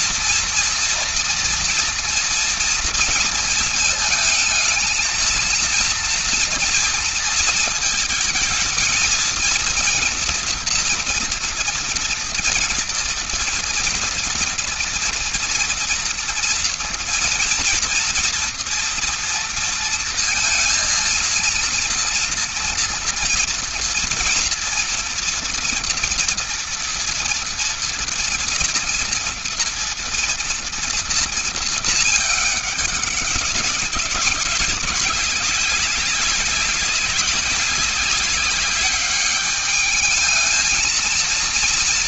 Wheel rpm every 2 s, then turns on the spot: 230, 230, 220, 230, 220, 240, 230, 230, 230, 230, 230, 230, 230, 230, 230, 230, 210, 200, 200, 200, 220.
none